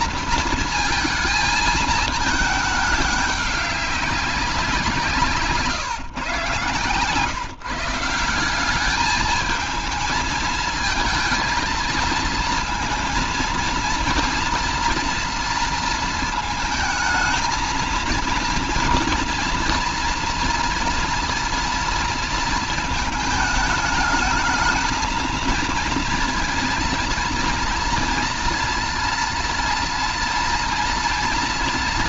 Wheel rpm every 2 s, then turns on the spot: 230, 210, 170, 130, 200, 230, 230, 240, 220, 230, 230, 220, 220, 230, 230, 230.
none